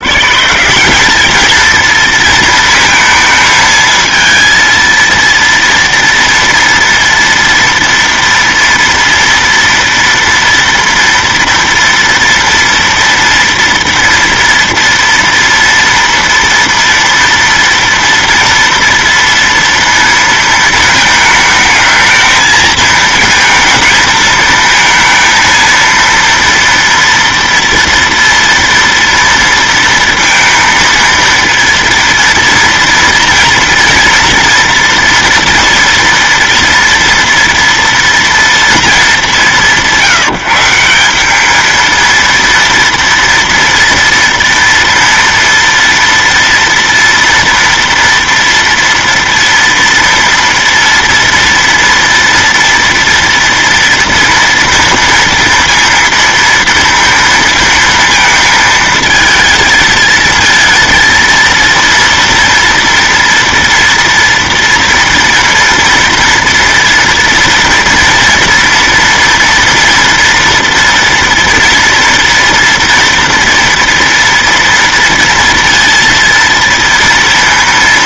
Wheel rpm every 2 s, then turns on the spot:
170, 230, 230, 230, 230, 230, 230, 230, 230, 230, 220, 220, 220, 230, 230, 230, 230, 230, 230, 230, 170, 230, 230, 230, 230, 230, 230, 230, 230, 220, 230, 230, 230, 230, 230, 230, 230, 230, 230.
none